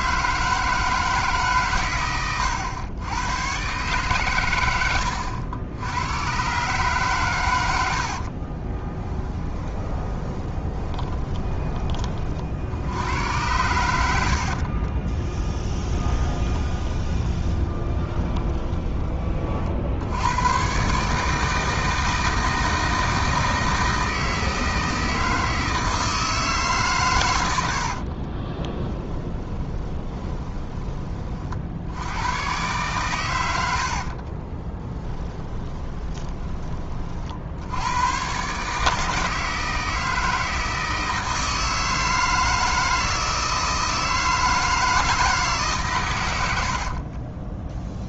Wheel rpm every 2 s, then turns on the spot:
160, 100, 100, 130, 20, 20, 80, 40, 20, 20, 130, 160, 160, 140, 20, 20, 120, 20, 30, 150, 160, 160, 160, 60.
8-12 14-20 28-30 34-36 46-48